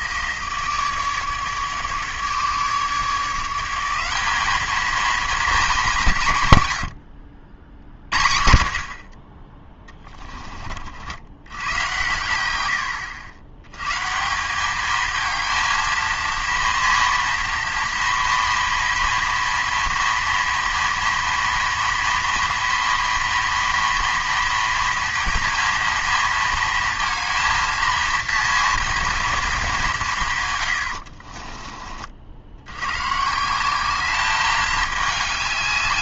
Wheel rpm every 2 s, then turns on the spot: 160, 150, 210, 130, 50, 30, 90, 190, 230, 230, 230, 230, 230, 230, 230, 120, 80, 210.
6-8